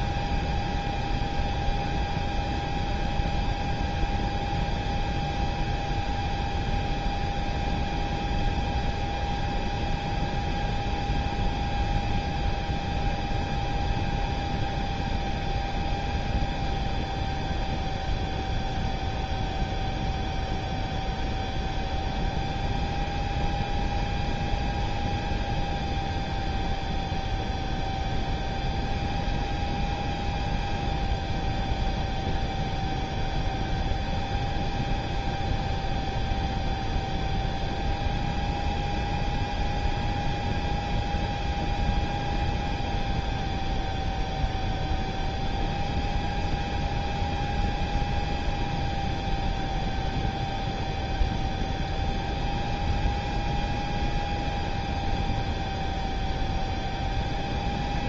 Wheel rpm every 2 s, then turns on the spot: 0, 0, 0, 0, 0, 0, 0, 0, 0, 0, 0, 0, 0, 0, 0, 0, 0, 0, 0, 0, 0, 0, 0, 0, 0, 0, 0, 0, 0.
none